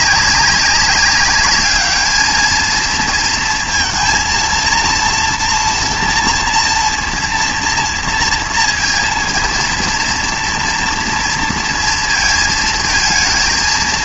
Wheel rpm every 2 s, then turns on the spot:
200, 220, 230, 230, 230, 230, 220.
none